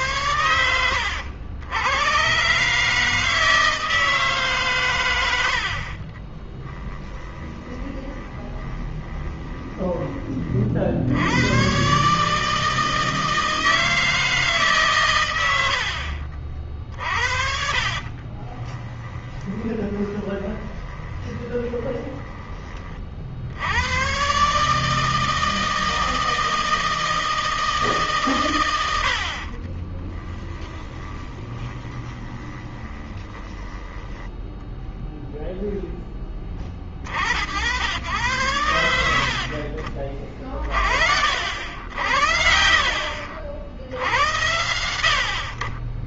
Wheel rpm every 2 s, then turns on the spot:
90, 150, 130, 10, 20, 60, 160, 130, 50, 20, 20, 40, 150, 160, 100, 20, 20, 10, 40, 90, 40, 60, 80.
6-10 16-22 30-34